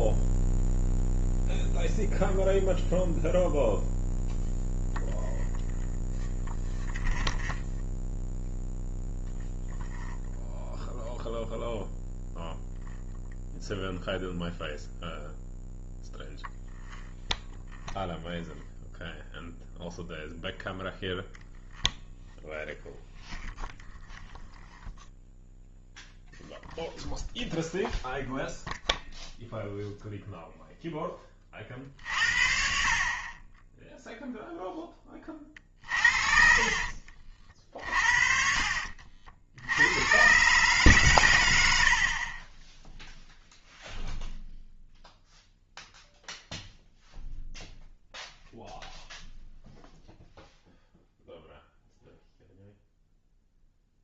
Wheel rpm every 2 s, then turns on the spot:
0, 0, 0, 0, 0, 0, 0, 0, 0, 0, 0, 0, 0, 0, 0, 0, 50, 10, 40, 60, 130, 10, 0, 0, 0, 0, 0.
36-40